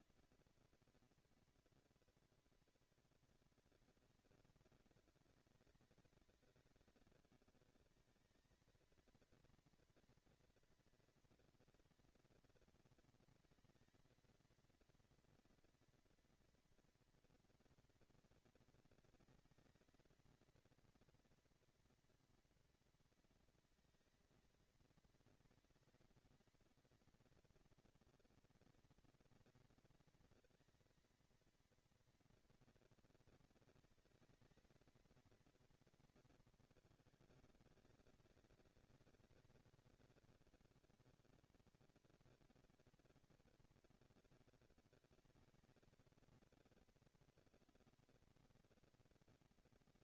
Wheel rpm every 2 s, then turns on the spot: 230, 230, 190, 200, 210, 230, 230, 230, 240, 230, 230, 230, 220, 230, 230, 220, 230, 220, 220, 200, 200, 230, 230, 230, 230.
none